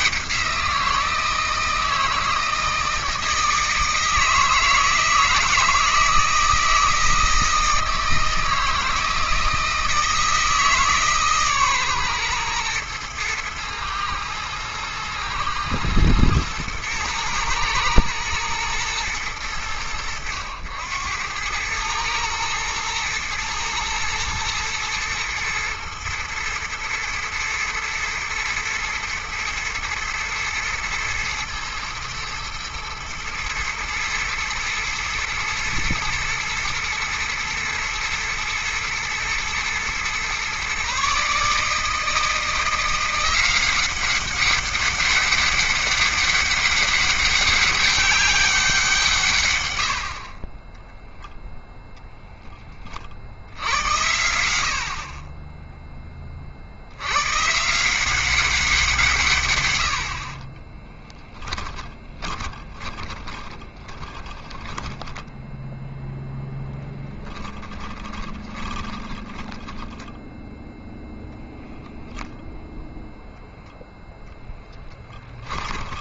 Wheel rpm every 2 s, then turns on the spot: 170, 160, 160, 160, 160, 150, 110, 110, 120, 110, 90, 110, 120, 110, 120, 110, 110, 110, 110, 120, 140, 170, 200, 200, 160, 10, 30, 50, 80, 170, 30, 30, 30, 10, 10, 0, 0, 10.
50-52 60-70 74-76